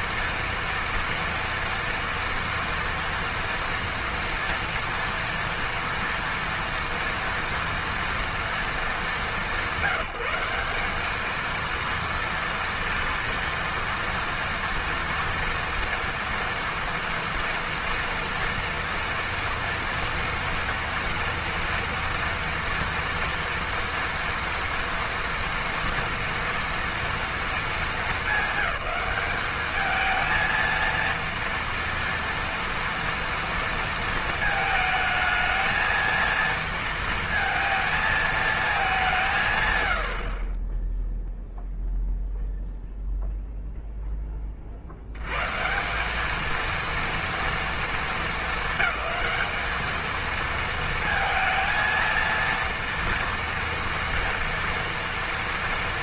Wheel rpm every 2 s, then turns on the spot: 230, 230, 230, 230, 230, 200, 230, 230, 230, 240, 230, 230, 230, 230, 200, 230, 230, 220, 230, 220, 30, 0, 30, 220, 220, 230, 230, 240.
none